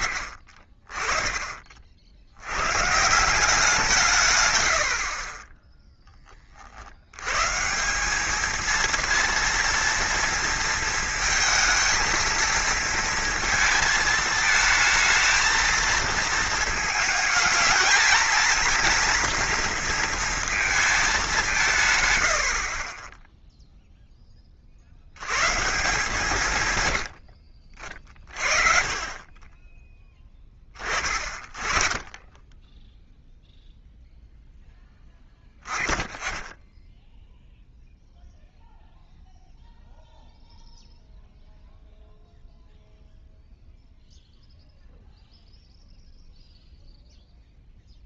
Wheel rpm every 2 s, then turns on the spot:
30, 150, 60, 70, 230, 230, 230, 220, 220, 230, 210, 20, 100, 90, 30, 30, 0, 20, 10, 0, 0, 0, 0, 0.
none